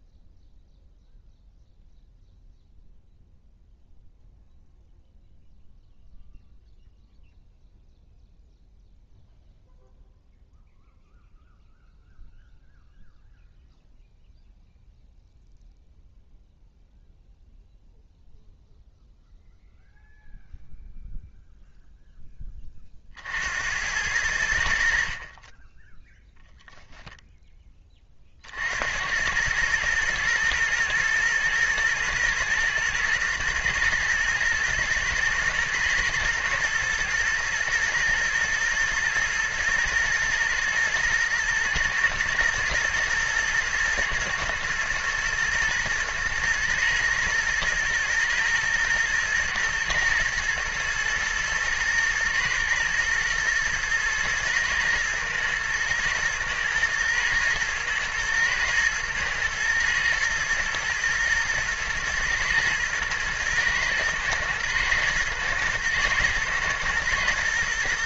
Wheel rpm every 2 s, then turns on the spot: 0, 0, 0, 0, 0, 0, 0, 0, 0, 0, 0, 30, 60, 0, 60, 120, 110, 120, 120, 110, 110, 120, 110, 110, 110, 110, 110, 110, 110, 110, 110, 120, 120, 120.
none